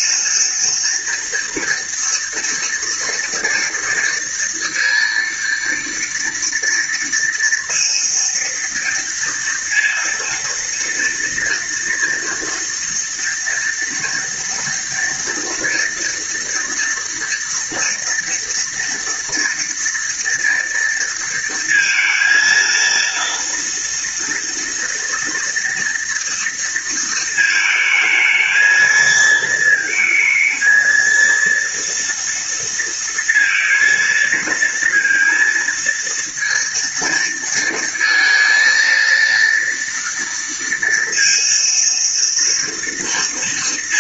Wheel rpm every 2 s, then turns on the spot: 230, 240, 230, 230, 230, 230, 230, 230, 230, 230, 230, 230, 230, 230, 220, 220, 230, 230, 230, 230, 230, 230.
none